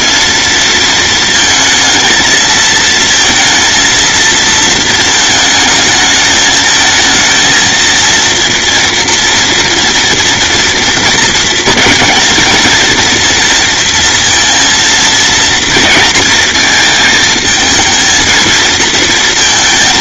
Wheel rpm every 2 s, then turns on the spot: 230, 230, 230, 220, 230, 230, 230, 230, 220, 230.
none